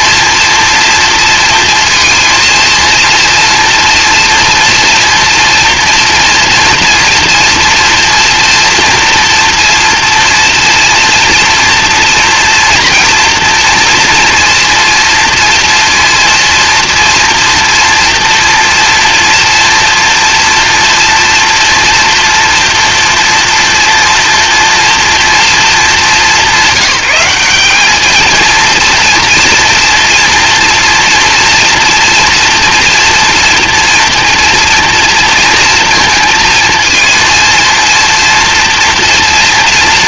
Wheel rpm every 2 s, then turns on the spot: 230, 230, 230, 240, 240, 230, 230, 230, 230, 230, 230, 230, 230, 190, 230, 230, 230, 240, 230, 230.
none